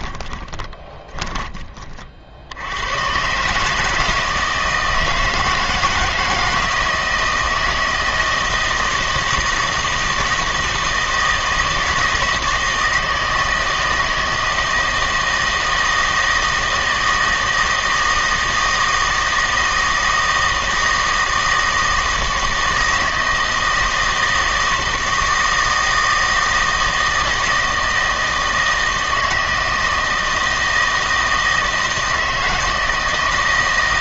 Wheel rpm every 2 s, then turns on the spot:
20, 100, 160, 160, 160, 160, 160, 160, 160, 160, 160, 160, 160, 160, 160, 160, 160.
0-2